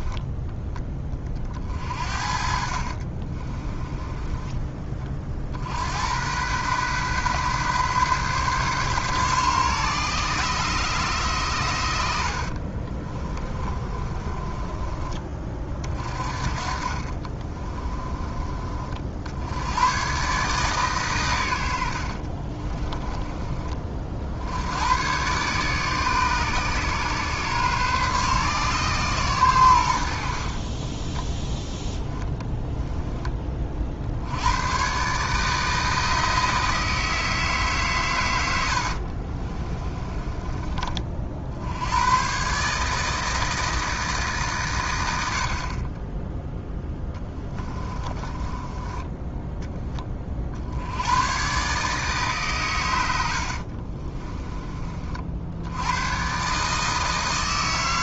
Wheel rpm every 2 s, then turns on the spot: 20, 50, 30, 120, 130, 130, 40, 20, 40, 40, 140, 30, 90, 140, 130, 30, 10, 120, 160, 80, 40, 150, 130, 10, 20, 70, 110, 30, 150.
2-4 12-14 16-18 22-24 30-32 38-40 46-50